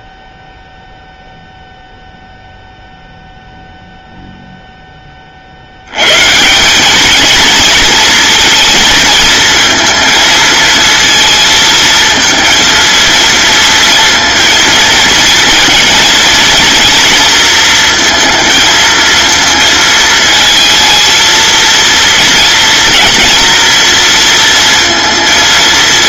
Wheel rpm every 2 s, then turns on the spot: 0, 0, 50, 220, 230, 220, 230, 230, 230, 230, 230, 230, 230.
none